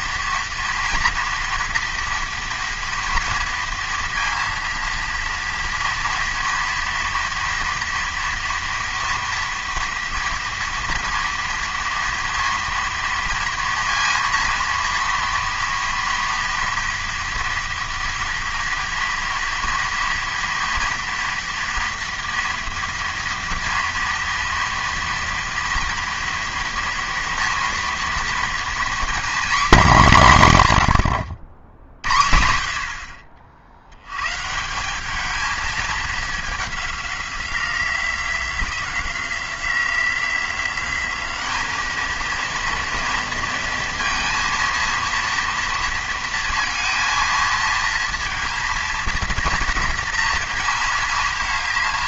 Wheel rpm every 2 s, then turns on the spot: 230, 230, 230, 230, 230, 230, 230, 230, 230, 230, 230, 230, 230, 230, 240, 110, 70, 160, 200, 180, 180, 230, 230, 230, 230, 230.
none